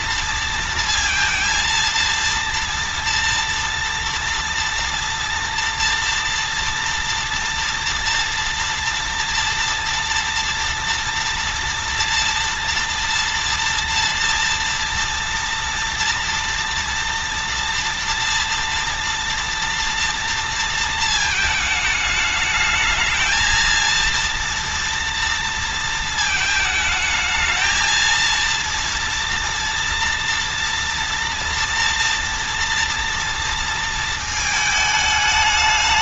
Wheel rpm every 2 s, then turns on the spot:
230, 240, 240, 230, 230, 230, 230, 230, 240, 240, 230, 220, 230, 220, 230, 230, 230, 210.
none